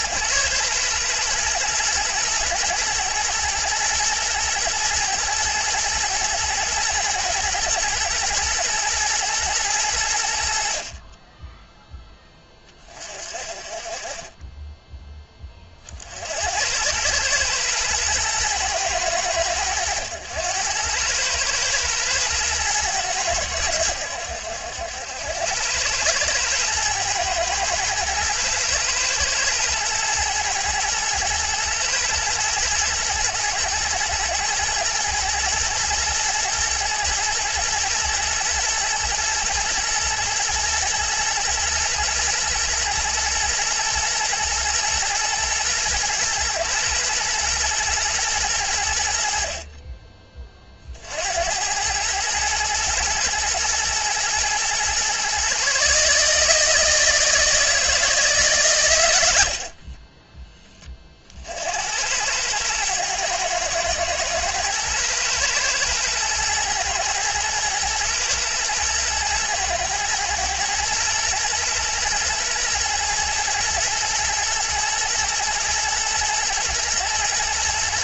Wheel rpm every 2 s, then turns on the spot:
110, 110, 110, 110, 120, 30, 30, 10, 100, 110, 100, 110, 80, 110, 110, 110, 110, 110, 110, 110, 120, 120, 120, 120, 80, 50, 110, 120, 160, 110, 30, 110, 110, 110, 110, 110, 110, 110, 110.
none